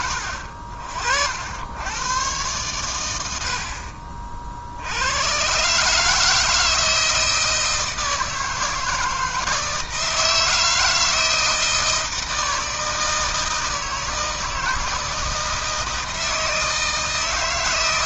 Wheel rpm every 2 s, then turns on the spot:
60, 110, 70, 160, 160, 160, 160, 160, 160.
none